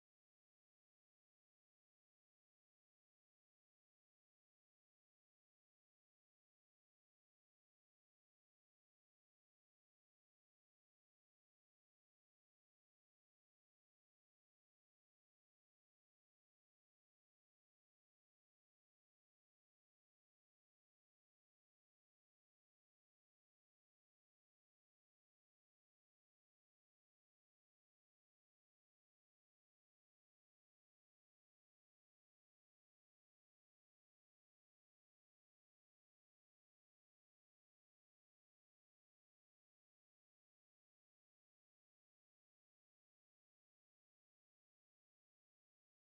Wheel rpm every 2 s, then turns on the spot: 0, 0, 0, 0, 0, 0, 0, 0, 0, 0, 0, 0, 0, 0, 0, 0, 0, 0, 0, 0, 0, 0, 0.
none